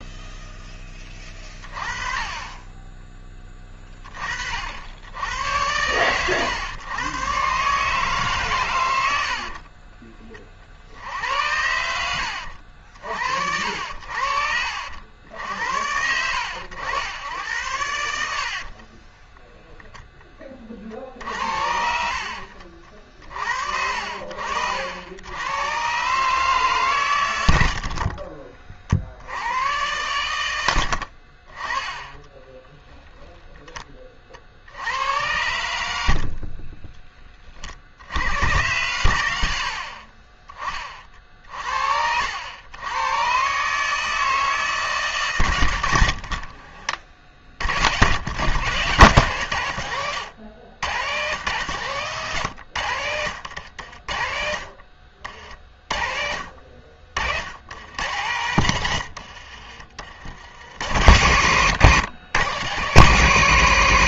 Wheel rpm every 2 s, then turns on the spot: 10, 10, 70, 110, 90, 60, 60, 70, 90, 50, 50, 50, 80, 130, 40, 70, 10, 60, 40, 90, 40, 110, 140, 40, 130, 110, 100, 40, 50, 110, 50, 70.
36-38